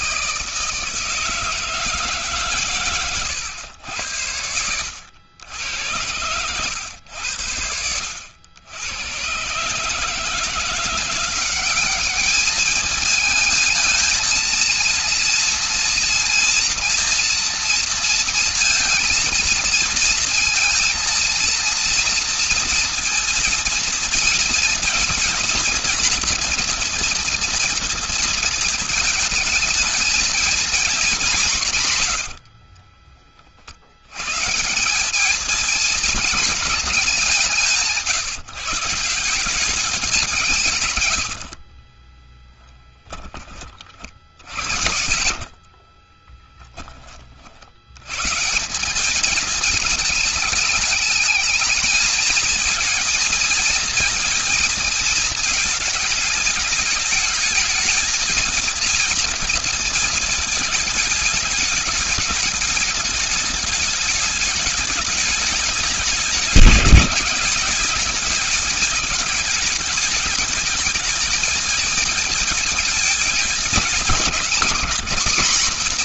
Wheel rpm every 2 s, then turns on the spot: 160, 140, 90, 90, 90, 160, 210, 230, 230, 230, 230, 230, 230, 230, 230, 230, 70, 130, 220, 150, 170, 20, 50, 10, 130, 210, 220, 220, 220, 230, 220, 210, 220, 210, 220, 210, 220, 220.
32-34 42-48